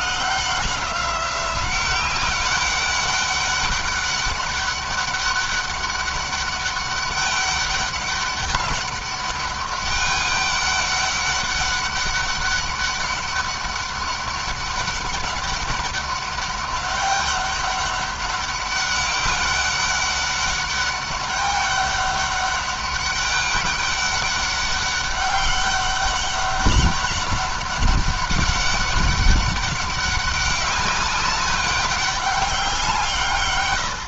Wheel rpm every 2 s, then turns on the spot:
180, 200, 200, 200, 200, 200, 200, 200, 200, 200, 200, 200, 200, 200, 200, 200, 180.
none